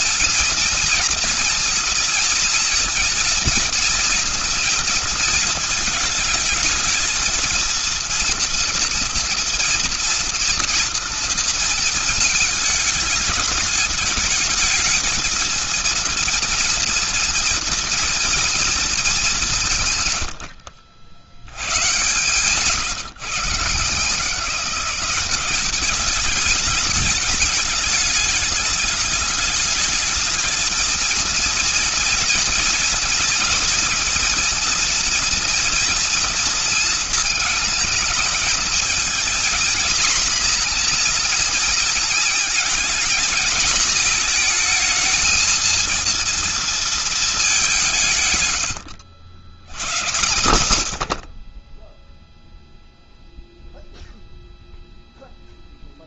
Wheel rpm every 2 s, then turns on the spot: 230, 230, 230, 220, 230, 230, 210, 220, 230, 210, 80, 140, 190, 210, 210, 220, 230, 230, 220, 220, 230, 220, 220, 220, 90, 70, 0, 0.
none